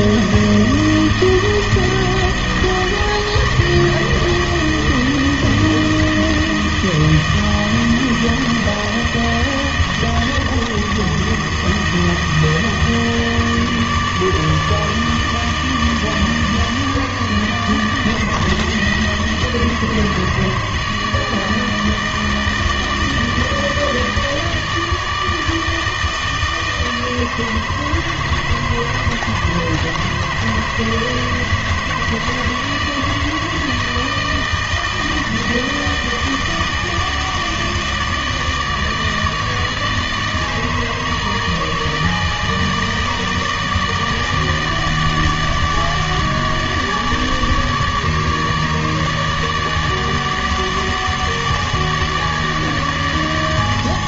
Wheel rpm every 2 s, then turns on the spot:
160, 160, 160, 160, 160, 160, 160, 150, 150, 160, 160, 160, 160, 160, 160, 160, 160, 160, 160, 160, 160, 160, 150, 150, 150, 150, 150.
none